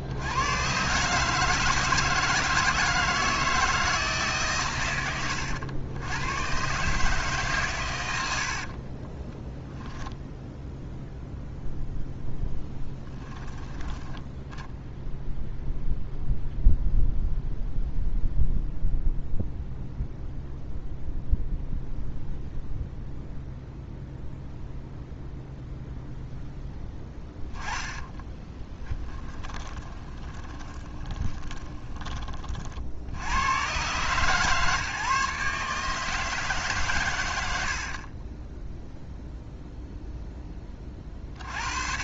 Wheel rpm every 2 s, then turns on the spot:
110, 160, 120, 130, 70, 0, 10, 10, 0, 0, 0, 0, 0, 10, 10, 20, 50, 140, 140, 10, 20.
8-10 12-14 28-32